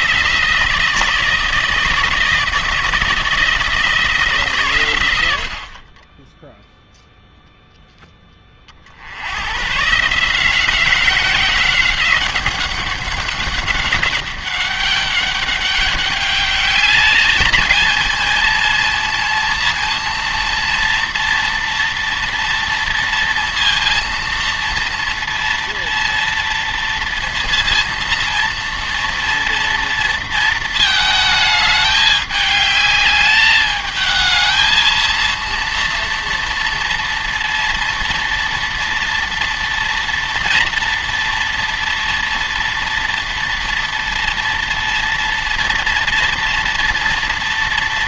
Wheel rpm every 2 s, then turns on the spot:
160, 160, 140, 0, 40, 180, 190, 200, 210, 230, 230, 230, 230, 230, 230, 220, 210, 220, 230, 230, 230, 230, 230, 230.
none